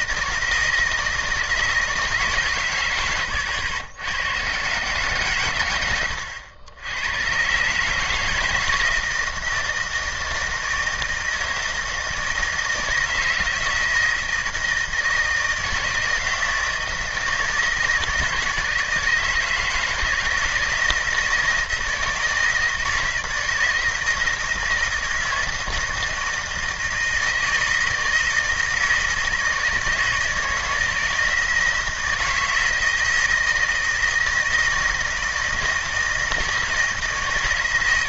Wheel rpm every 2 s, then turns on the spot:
160, 130, 120, 90, 160, 160, 160, 160, 160, 160, 160, 160, 160, 160, 160, 160, 160, 160, 160.
none